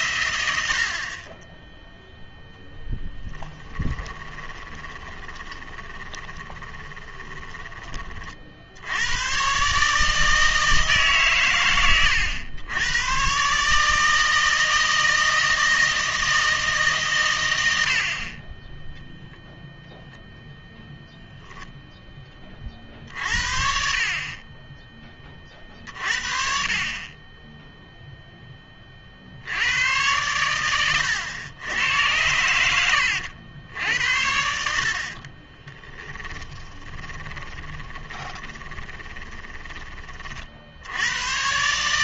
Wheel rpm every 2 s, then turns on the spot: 90, 10, 20, 20, 60, 160, 90, 160, 160, 20, 0, 40, 20, 50, 20, 100, 90, 70, 10, 20, 60.
4-8 32-34 36-40